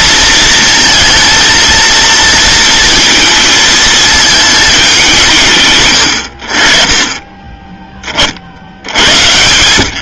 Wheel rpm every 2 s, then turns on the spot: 230, 230, 210, 50, 70.
none